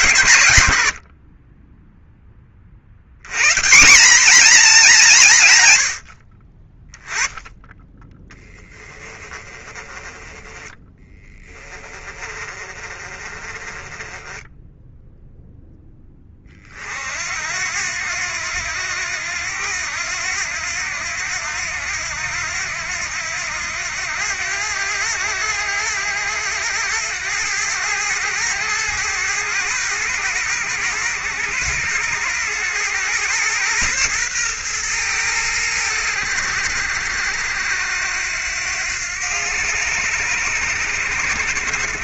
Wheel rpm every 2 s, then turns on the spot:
100, 50, 210, 20, 20, 10, 20, 10, 40, 90, 90, 90, 90, 100, 100, 110, 110, 110, 80, 90, 100.
8-10